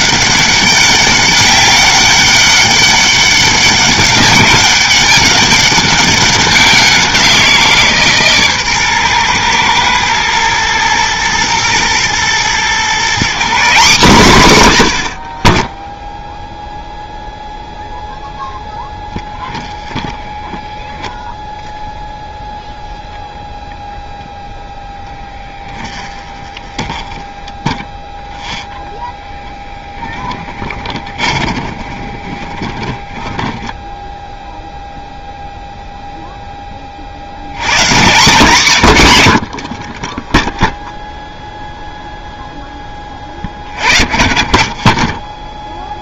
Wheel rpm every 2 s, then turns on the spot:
200, 200, 200, 190, 130, 120, 140, 120, 0, 10, 0, 0, 0, 20, 0, 20, 20, 0, 30, 110, 0, 10, 30.
26-28 30-34